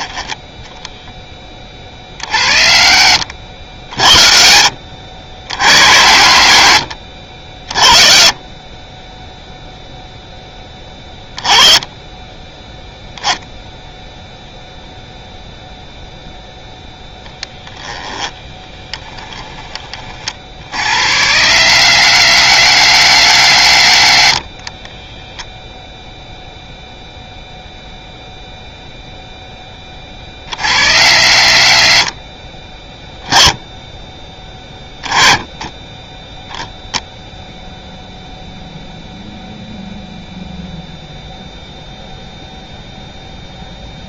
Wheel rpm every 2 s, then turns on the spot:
0, 40, 50, 80, 20, 10, 10, 0, 0, 10, 40, 90, 30, 0, 0, 50, 20, 10, 0, 0, 0, 0.
4-6 18-20 32-34